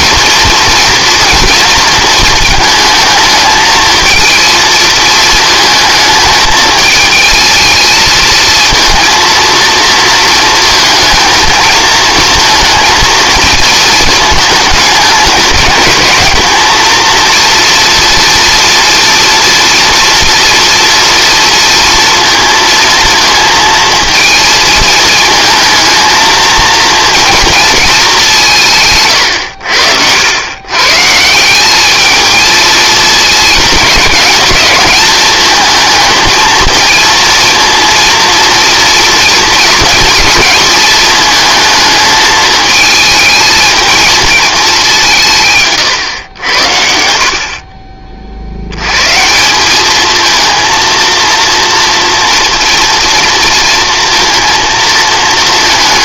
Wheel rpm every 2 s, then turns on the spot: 230, 220, 230, 220, 230, 230, 230, 220, 230, 230, 240, 230, 220, 230, 150, 120, 230, 220, 230, 230, 210, 220, 200, 70, 90, 220, 230, 230.
none